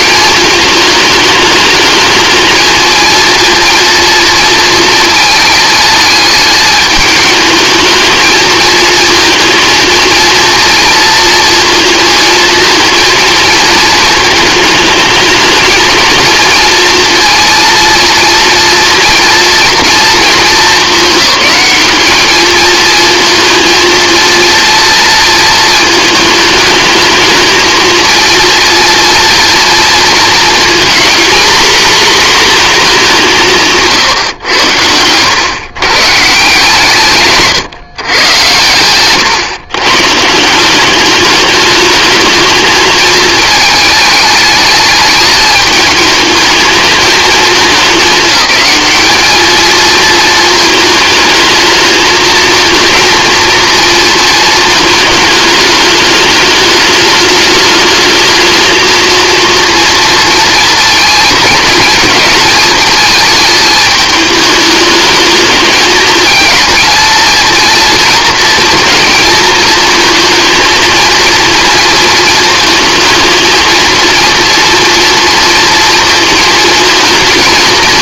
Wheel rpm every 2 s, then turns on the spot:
210, 220, 230, 210, 220, 230, 230, 220, 230, 230, 220, 220, 230, 220, 230, 230, 230, 100, 150, 120, 180, 220, 210, 220, 210, 220, 220, 220, 210, 220, 230, 220, 210, 220, 230, 230, 220, 230, 220.
none